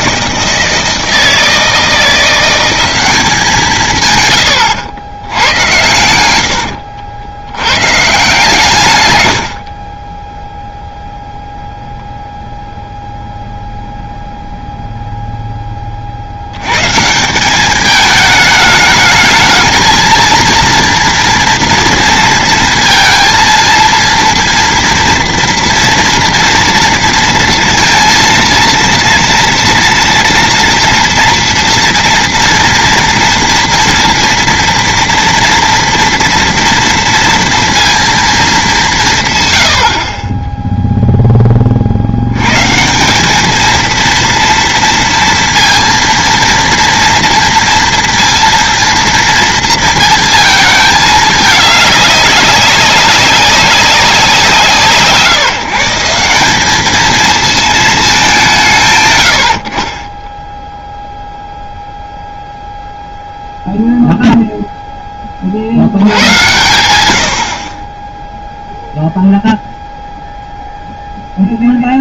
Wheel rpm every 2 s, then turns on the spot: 160, 180, 120, 90, 150, 0, 0, 0, 100, 210, 230, 230, 230, 230, 230, 230, 240, 230, 230, 210, 10, 130, 230, 230, 230, 220, 200, 170, 190, 170, 0, 0, 0, 90, 0, 0.
4-6 8-10